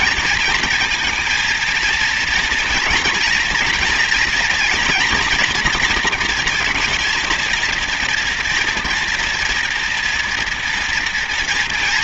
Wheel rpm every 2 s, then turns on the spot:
220, 230, 240, 230, 230, 230.
none